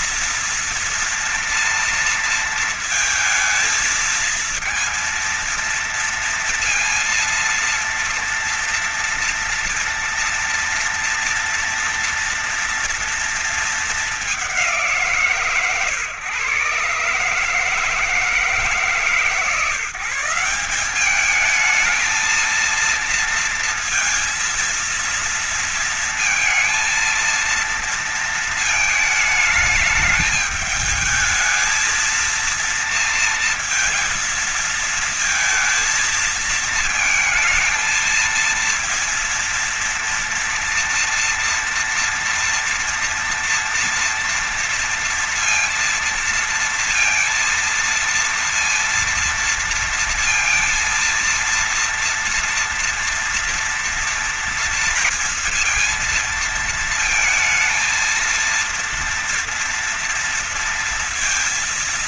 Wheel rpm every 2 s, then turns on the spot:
230, 220, 230, 230, 240, 230, 230, 160, 140, 140, 200, 230, 230, 230, 220, 220, 230, 220, 220, 230, 230, 230, 230, 230, 230, 230, 230, 230, 230, 230, 230.
none